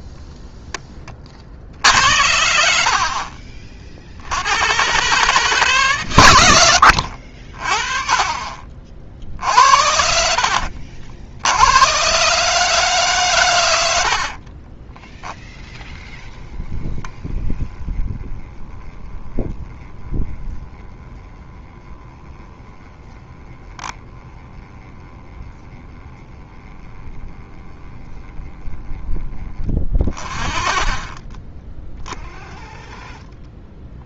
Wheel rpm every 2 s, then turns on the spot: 10, 60, 110, 90, 50, 60, 150, 40, 10, 10, 10, 10, 10, 10, 10, 30, 30.
6-12 14-16